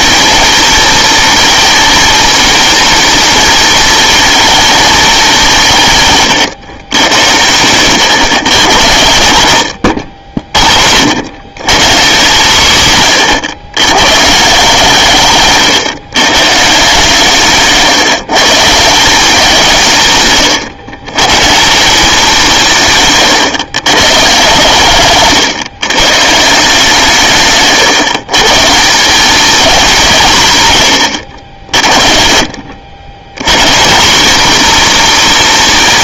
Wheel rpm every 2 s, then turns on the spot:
230, 220, 230, 110, 110, 60, 150, 150, 140, 150, 120, 170, 140, 160, 150, 150, 80, 230.
none